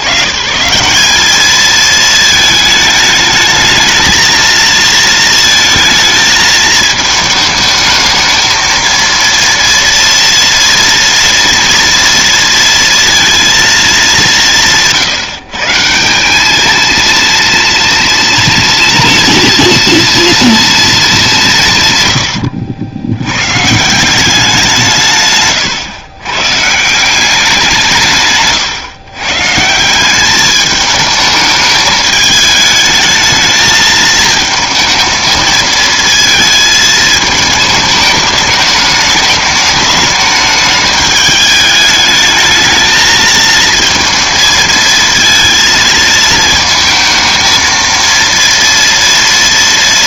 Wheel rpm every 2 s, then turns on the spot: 130, 220, 230, 220, 220, 230, 230, 170, 220, 240, 230, 90, 170, 140, 140, 210, 220, 220, 220, 210, 210, 220, 220, 220, 230.
none